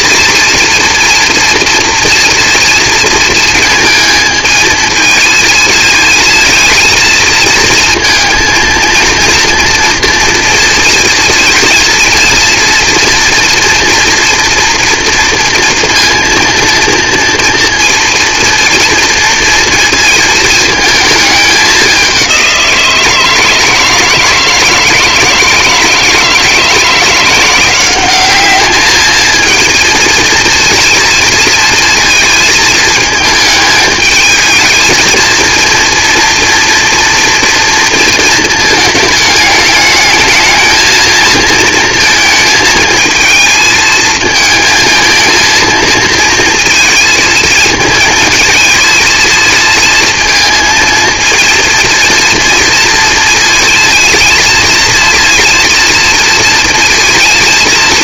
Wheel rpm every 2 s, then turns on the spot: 230, 230, 220, 230, 230, 240, 230, 230, 230, 230, 220, 180, 160, 160, 210, 230, 220, 220, 230, 220, 220, 220, 220, 230, 230, 230, 230, 220, 230.
none